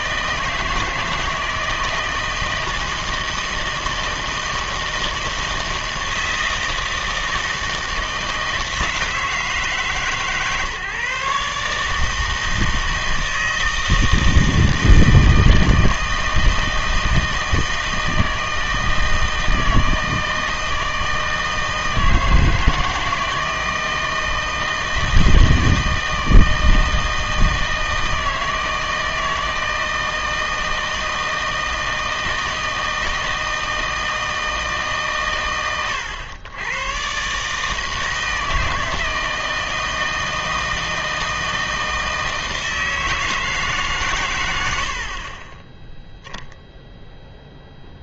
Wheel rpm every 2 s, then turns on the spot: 160, 160, 160, 160, 160, 150, 160, 160, 160, 160, 160, 160, 160, 160, 160, 160, 160, 150, 110, 160, 160, 160, 60, 0.
44-46